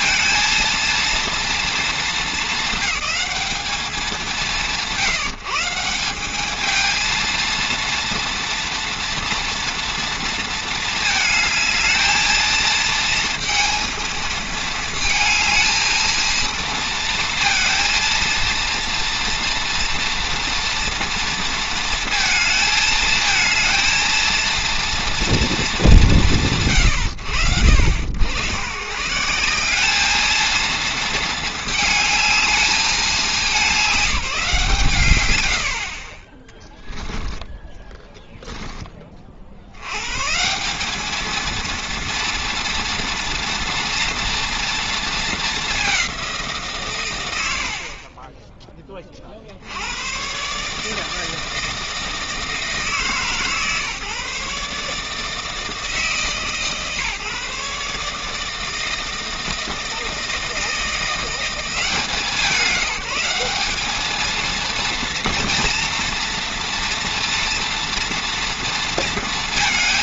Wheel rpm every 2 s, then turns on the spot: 230, 220, 150, 220, 230, 220, 220, 230, 230, 230, 240, 220, 230, 80, 120, 220, 210, 160, 10, 10, 190, 230, 230, 130, 10, 150, 160, 140, 150, 160, 170, 190, 230, 230, 230.
36-38